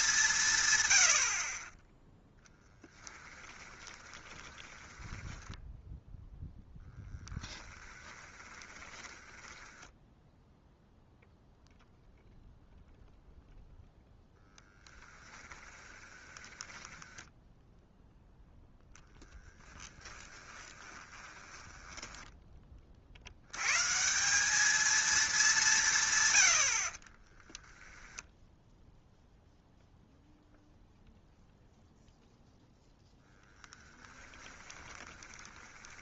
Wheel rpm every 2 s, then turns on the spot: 110, 10, 10, 0, 20, 0, 0, 10, 10, 10, 20, 40, 220, 50, 0, 0, 10, 20.
2-6 8-10 14-18 20-22 34-36